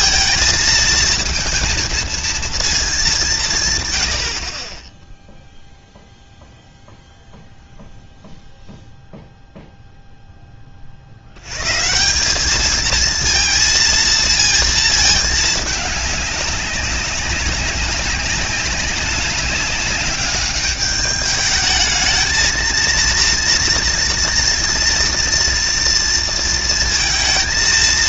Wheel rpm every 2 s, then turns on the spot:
230, 220, 40, 0, 0, 20, 210, 230, 200, 200, 200, 230, 230, 230.
none